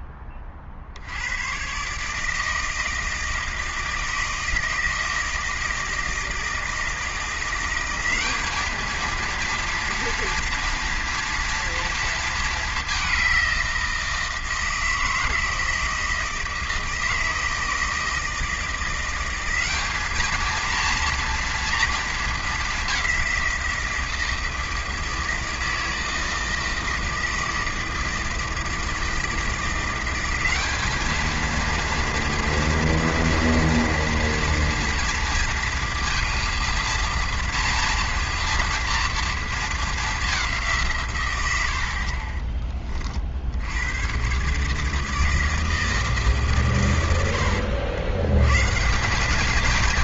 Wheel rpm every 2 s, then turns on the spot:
50, 160, 160, 160, 220, 230, 220, 160, 160, 170, 230, 210, 160, 160, 160, 200, 230, 240, 230, 240, 180, 30, 140, 130, 140.
none